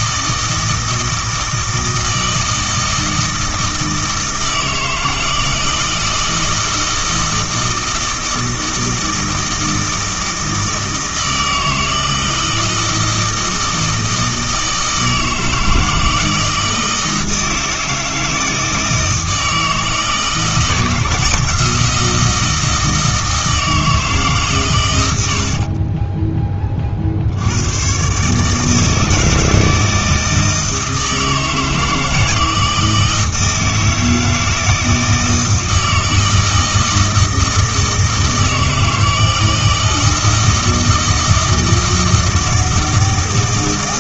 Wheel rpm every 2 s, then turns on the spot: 160, 160, 160, 160, 160, 160, 160, 160, 160, 160, 160, 160, 110, 20, 160, 160, 160, 160, 160, 160, 160, 160.
none